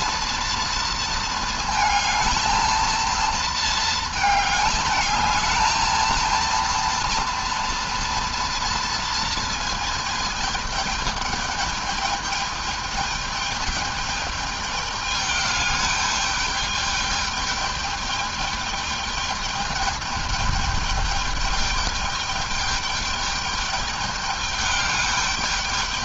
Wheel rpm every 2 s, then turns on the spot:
230, 230, 220, 230, 230, 210, 210, 210, 210, 210, 210, 210, 210.
none